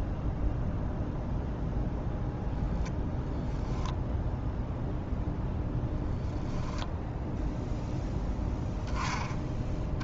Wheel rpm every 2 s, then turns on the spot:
0, 0, 0, 0, 10.
none